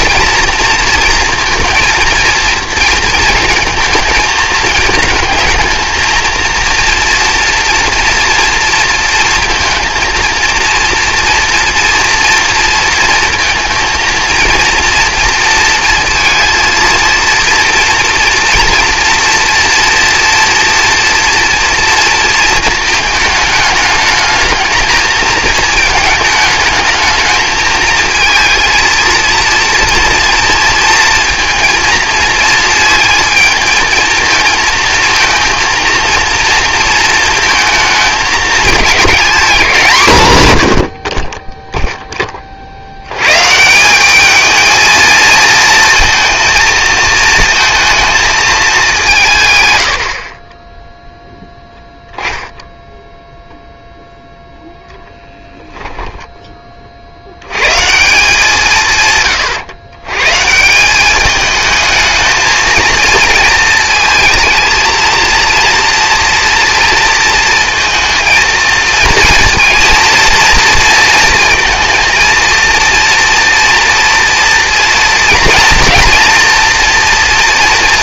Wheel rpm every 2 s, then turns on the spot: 230, 230, 220, 230, 230, 230, 230, 230, 230, 230, 230, 220, 220, 220, 230, 230, 220, 230, 230, 210, 90, 60, 220, 230, 200, 20, 0, 0, 30, 160, 170, 220, 220, 230, 230, 230, 230, 230, 230.
none